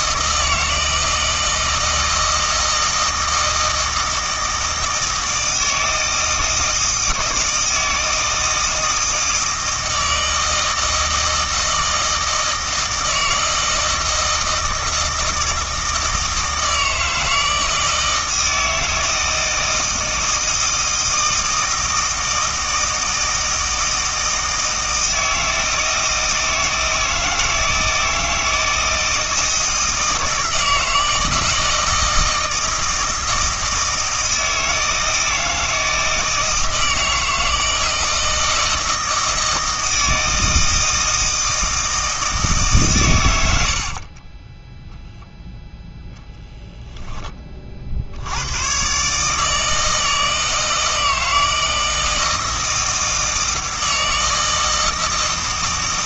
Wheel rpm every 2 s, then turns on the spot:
160, 160, 160, 160, 160, 160, 160, 160, 160, 160, 160, 160, 160, 160, 160, 160, 160, 160, 160, 160, 160, 150, 10, 0, 120, 160, 160, 160.
44-46